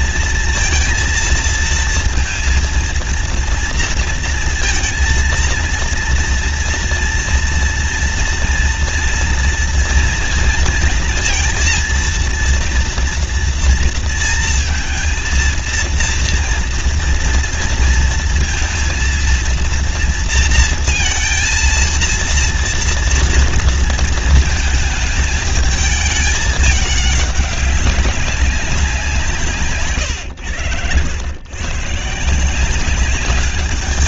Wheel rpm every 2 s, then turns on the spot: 230, 230, 230, 230, 230, 230, 230, 230, 230, 230, 230, 230, 220, 210, 180, 90, 180.
none